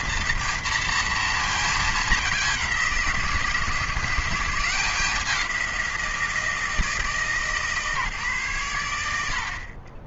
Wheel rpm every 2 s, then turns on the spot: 230, 190, 190, 160, 110.
none